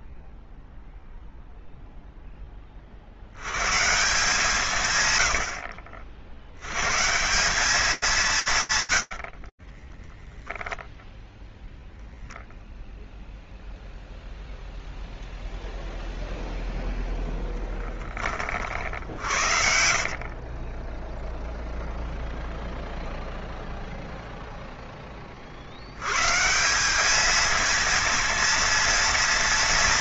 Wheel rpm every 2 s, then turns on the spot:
0, 40, 100, 150, 110, 0, 0, 0, 0, 60, 0, 0, 20, 200, 230.
18-20